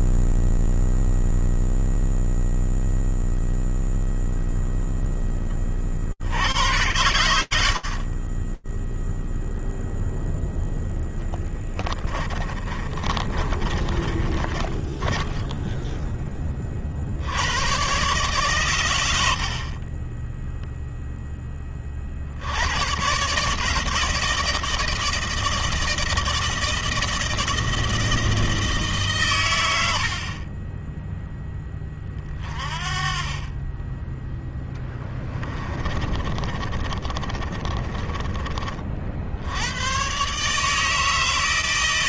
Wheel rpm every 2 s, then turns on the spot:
0, 0, 0, 30, 40, 0, 20, 20, 30, 120, 0, 90, 160, 160, 160, 30, 30, 10, 20, 30, 150.
12-16 36-38